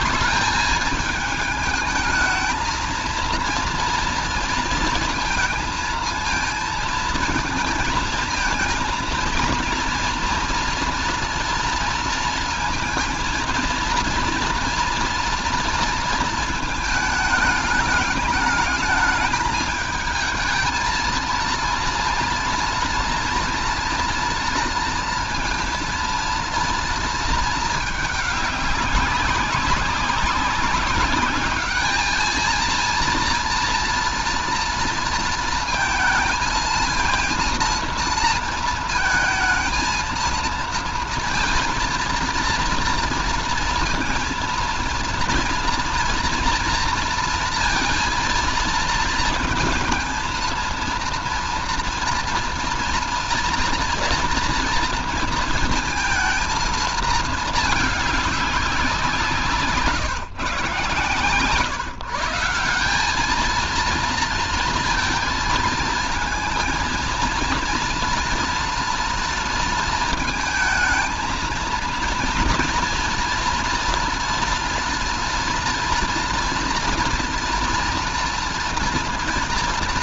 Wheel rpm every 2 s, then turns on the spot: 200, 220, 230, 230, 230, 240, 230, 230, 230, 210, 220, 230, 230, 230, 210, 200, 220, 230, 220, 230, 230, 230, 230, 230, 230, 230, 230, 230, 220, 200, 130, 160, 230, 220, 230, 220, 230, 230, 230, 230.
none